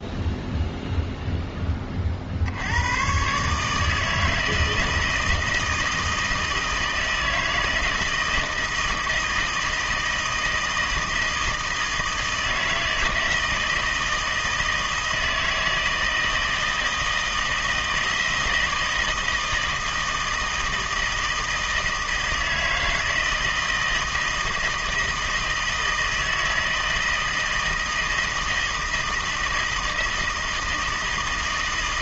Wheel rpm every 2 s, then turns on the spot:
0, 90, 160, 160, 160, 160, 160, 160, 160, 160, 160, 160, 160, 160, 160, 160.
none